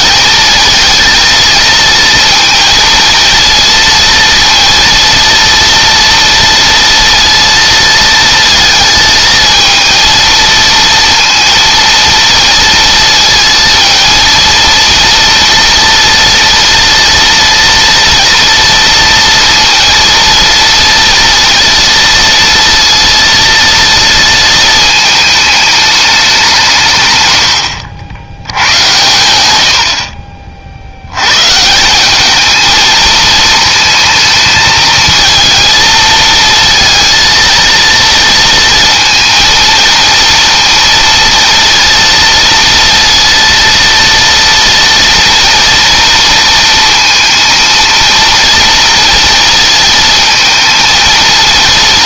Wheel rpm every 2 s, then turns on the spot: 230, 230, 230, 230, 220, 230, 230, 230, 230, 230, 230, 230, 220, 150, 100, 60, 220, 230, 230, 230, 230, 230, 230, 230, 230, 220.
none